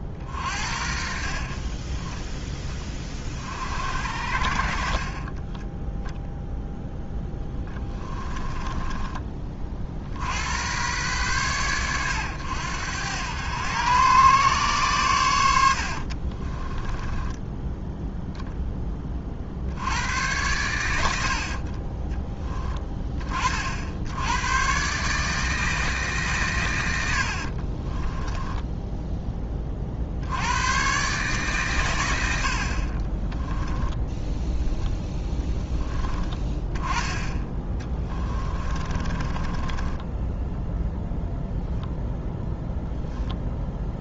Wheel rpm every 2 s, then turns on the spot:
50, 20, 40, 10, 20, 110, 100, 120, 20, 20, 90, 20, 130, 90, 10, 120, 50, 0, 10, 30, 0, 0.
8-10 16-18 38-40